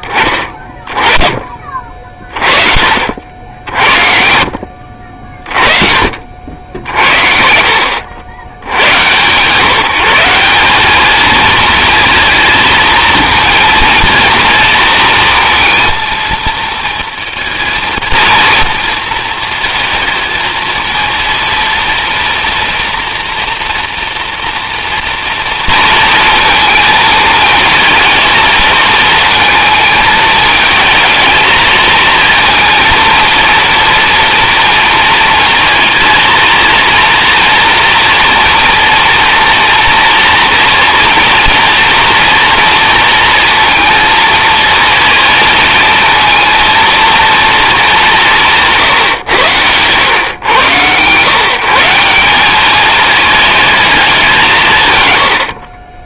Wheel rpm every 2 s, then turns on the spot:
20, 50, 60, 70, 100, 190, 230, 220, 230, 230, 230, 230, 230, 230, 220, 210, 220, 230, 230, 230, 230, 230, 230, 230, 150, 120, 210, 140.
none